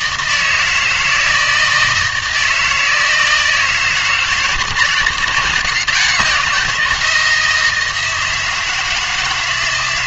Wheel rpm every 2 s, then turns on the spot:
160, 160, 160, 170, 160.
none